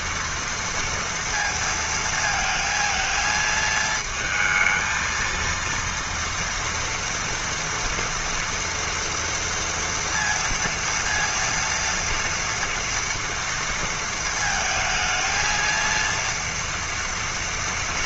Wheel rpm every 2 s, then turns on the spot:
230, 220, 230, 230, 230, 230, 230, 220, 230.
none